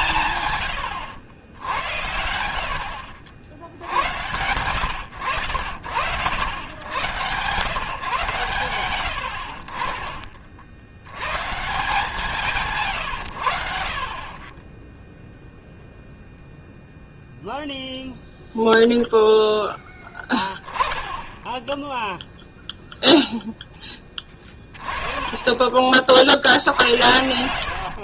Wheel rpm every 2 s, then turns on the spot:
110, 60, 100, 120, 110, 70, 150, 10, 0, 0, 10, 0, 30, 70.
20-22